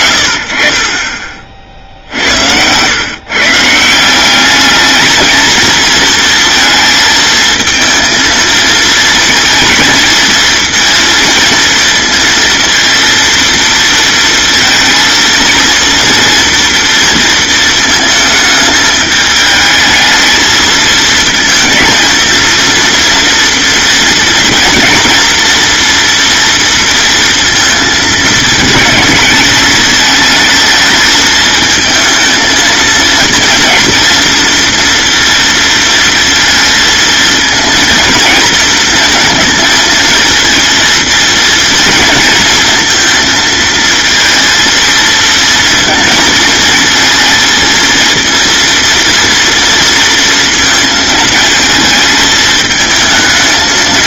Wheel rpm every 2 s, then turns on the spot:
70, 90, 200, 230, 220, 220, 230, 230, 230, 220, 220, 230, 240, 230, 220, 220, 220, 230, 230, 220, 230, 230, 230, 220, 230, 230, 220.
none